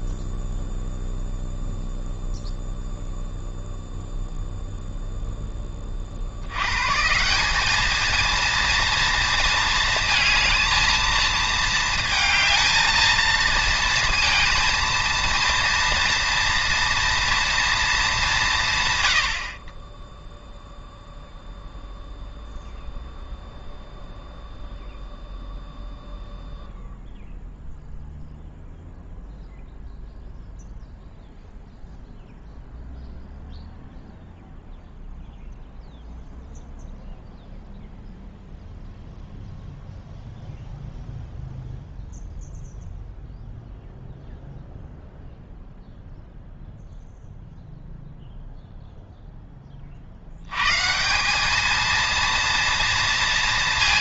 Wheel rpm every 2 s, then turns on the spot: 0, 0, 0, 110, 230, 220, 220, 230, 230, 140, 0, 0, 0, 0, 0, 0, 0, 0, 0, 0, 0, 0, 0, 0, 0, 130, 230.
none